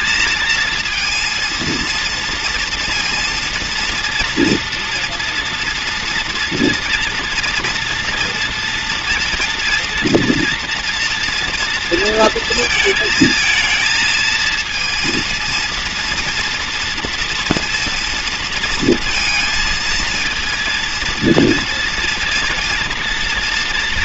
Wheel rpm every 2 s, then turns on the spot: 230, 230, 240, 230, 230, 230, 230, 220, 240, 230, 230, 230.
none